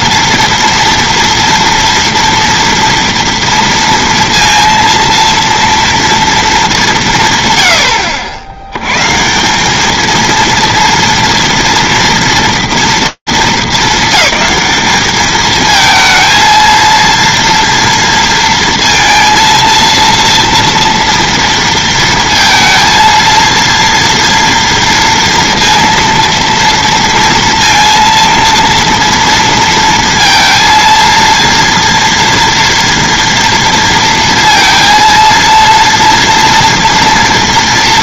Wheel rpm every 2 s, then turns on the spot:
230, 230, 230, 230, 80, 230, 230, 210, 220, 230, 230, 230, 230, 230, 230, 230, 230, 230, 230.
none